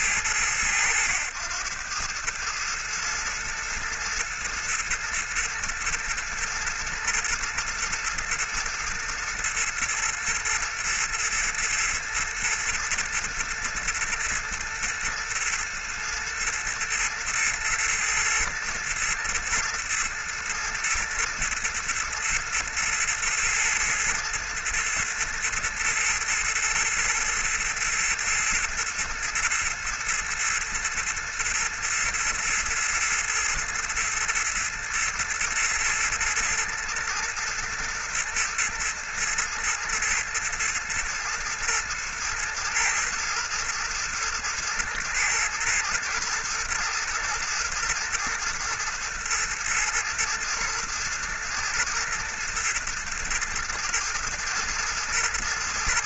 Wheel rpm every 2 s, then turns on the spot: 100, 110, 110, 120, 110, 120, 110, 110, 120, 110, 120, 110, 120, 120, 110, 110, 110, 110, 110, 110, 120, 110, 120, 110, 110, 120, 110, 120.
none